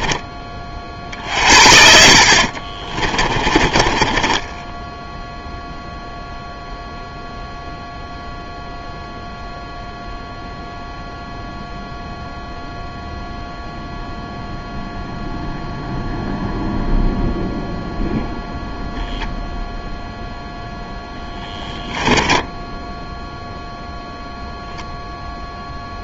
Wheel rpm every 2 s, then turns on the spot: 30, 40, 10, 0, 0, 0, 0, 0, 0, 0, 0, 10, 0.
2-6 22-24